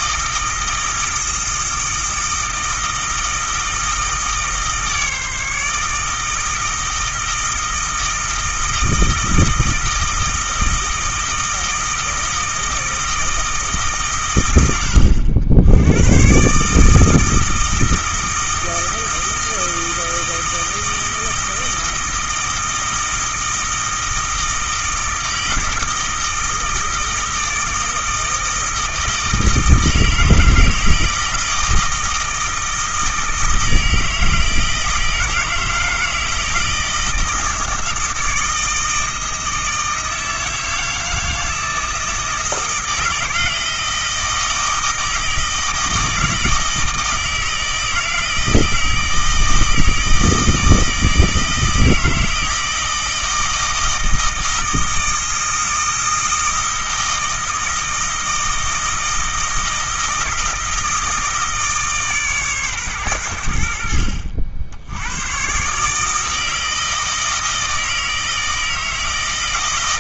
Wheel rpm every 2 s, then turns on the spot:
160, 160, 150, 160, 160, 160, 160, 90, 150, 160, 160, 160, 160, 160, 160, 160, 160, 160, 160, 160, 160, 160, 160, 160, 160, 160, 160, 160, 160, 160, 160, 120, 90, 160, 160.
none